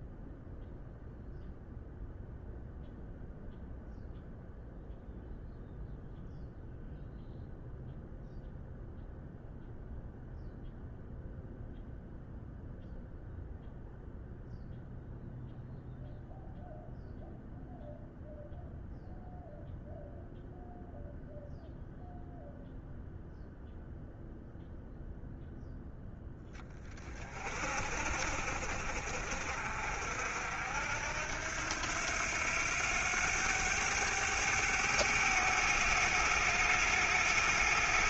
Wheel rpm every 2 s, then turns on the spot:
0, 0, 0, 0, 0, 0, 0, 0, 0, 0, 0, 0, 0, 20, 50, 70, 90, 100, 100.
none